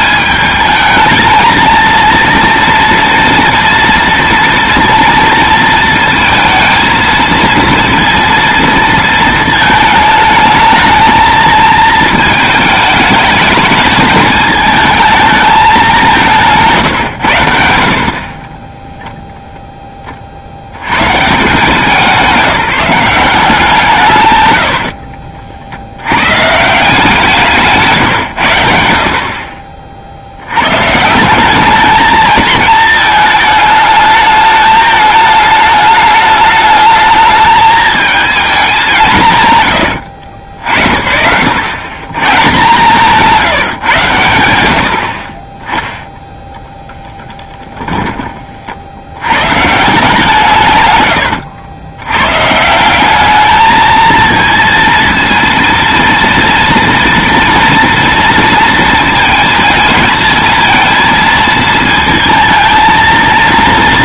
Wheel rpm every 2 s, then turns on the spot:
220, 230, 230, 230, 230, 220, 210, 220, 140, 20, 80, 180, 80, 150, 80, 130, 220, 210, 210, 200, 60, 150, 80, 0, 50, 130, 160, 230, 230, 230, 230, 220.
18-20 42-44